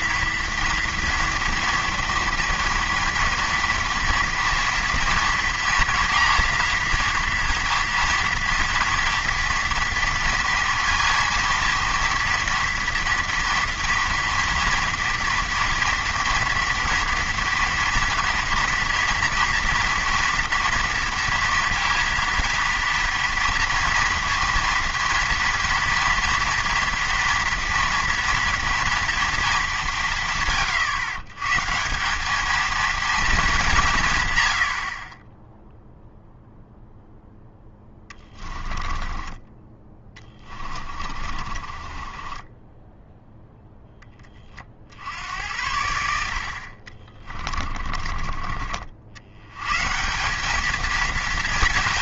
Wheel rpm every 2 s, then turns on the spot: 230, 240, 230, 240, 230, 230, 230, 230, 230, 230, 230, 230, 230, 230, 230, 130, 220, 70, 0, 20, 30, 10, 50, 60, 40, 210.
38-44